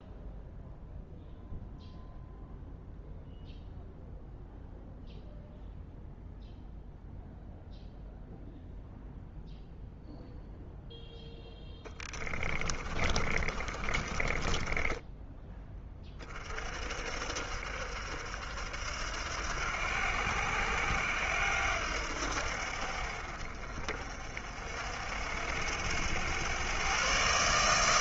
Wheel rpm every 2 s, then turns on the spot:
0, 0, 0, 0, 0, 0, 30, 20, 40, 70, 80, 60, 60, 110.
12-16